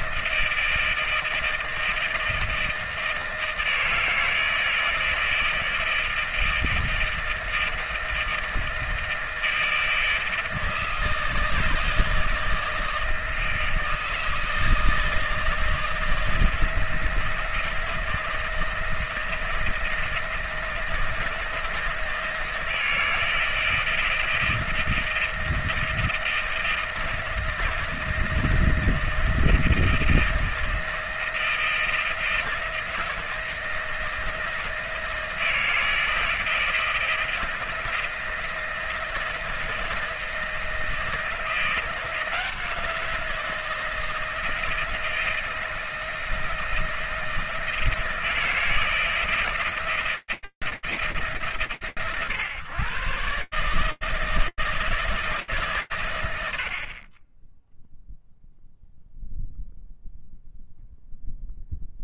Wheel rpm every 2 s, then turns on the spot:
160, 160, 160, 160, 160, 160, 160, 160, 160, 170, 160, 160, 170, 160, 160, 170, 170, 170, 160, 160, 160, 170, 160, 160, 170, 130, 160, 160, 40, 0, 0.
none